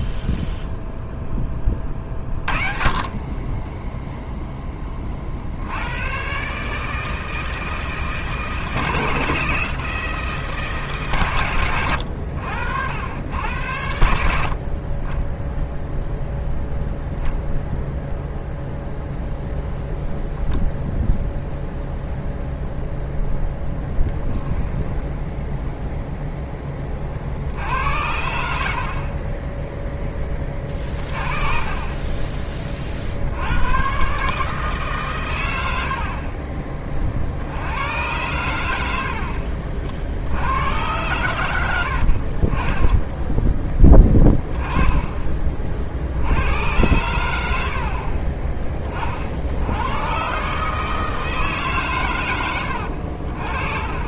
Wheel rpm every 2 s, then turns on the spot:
0, 40, 10, 150, 160, 150, 80, 60, 0, 0, 0, 0, 10, 20, 70, 20, 30, 150, 30, 90, 90, 30, 10, 90, 30, 150, 80.
none